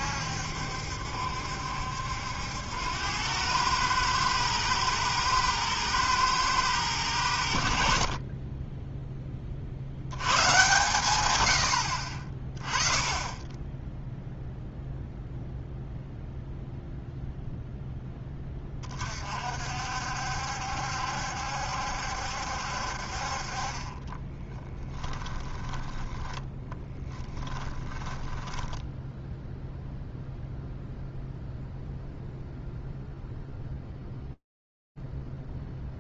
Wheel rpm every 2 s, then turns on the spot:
70, 90, 110, 100, 10, 130, 20, 0, 0, 30, 70, 60, 20, 10, 10, 0, 0, 0.
24-30